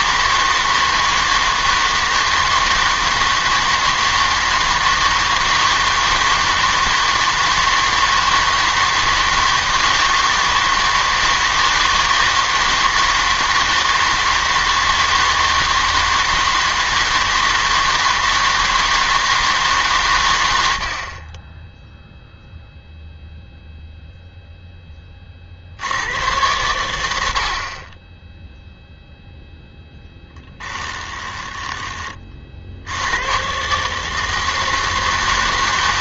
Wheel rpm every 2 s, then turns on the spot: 160, 160, 160, 160, 160, 160, 160, 160, 160, 160, 90, 0, 10, 100, 0, 10, 60, 160.
30-32